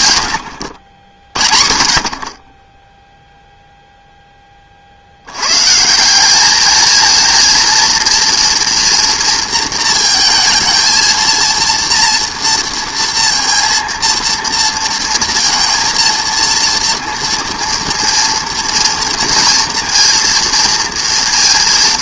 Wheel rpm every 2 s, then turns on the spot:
90, 20, 30, 210, 230, 230, 230, 230, 230, 230, 230.
none